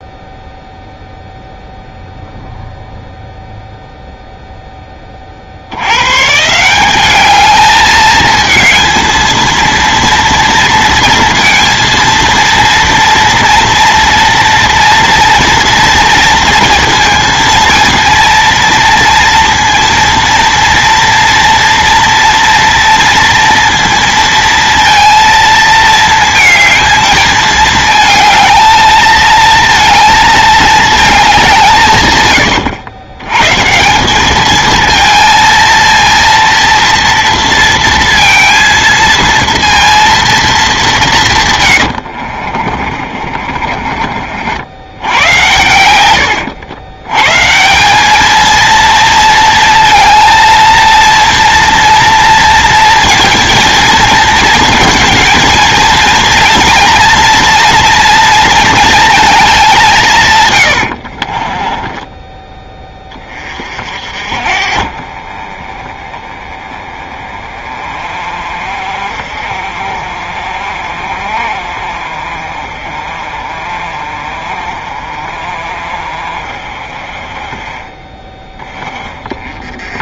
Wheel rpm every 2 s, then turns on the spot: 0, 0, 10, 170, 220, 230, 230, 230, 230, 230, 230, 230, 230, 220, 230, 220, 100, 220, 230, 230, 210, 40, 90, 90, 220, 230, 230, 230, 230, 230, 100, 10, 50, 20, 40, 50, 40, 40, 40, 20.
32-34 42-44 60-62